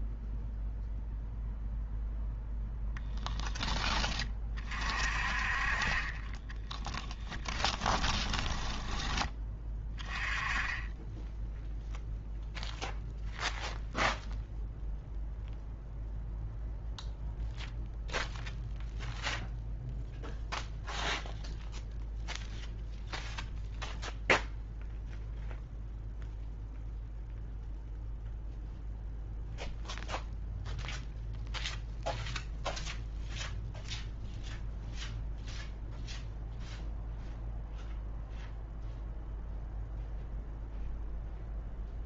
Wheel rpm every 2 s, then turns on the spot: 0, 0, 40, 30, 10, 10, 0, 0, 0, 0, 0, 0, 0, 0, 0, 0, 0, 0, 0, 0, 0.
6-8